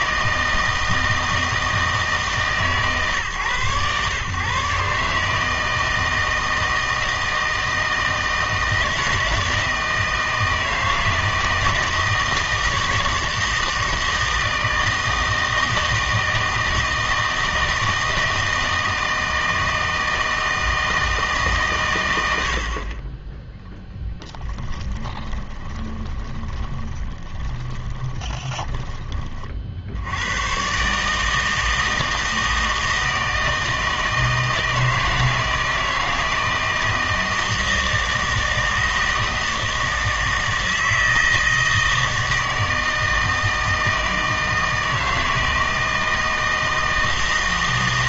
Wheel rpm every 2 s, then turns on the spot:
160, 140, 140, 160, 160, 160, 160, 160, 160, 160, 160, 50, 10, 20, 20, 120, 160, 160, 160, 160, 160, 160, 160, 160.
24-30